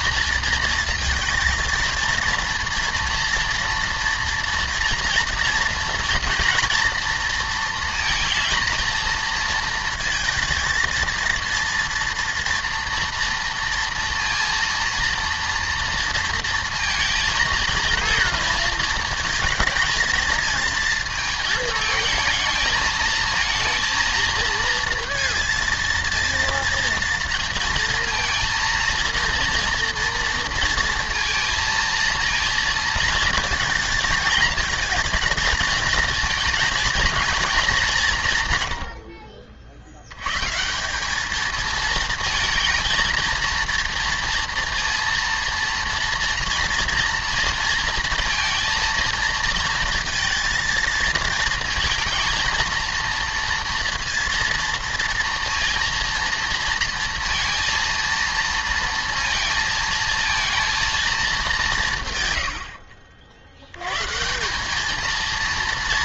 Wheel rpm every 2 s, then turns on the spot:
230, 230, 230, 230, 230, 230, 230, 230, 230, 230, 220, 220, 230, 230, 230, 230, 230, 230, 230, 110, 160, 220, 230, 230, 220, 230, 230, 230, 230, 230, 230, 90, 190.
none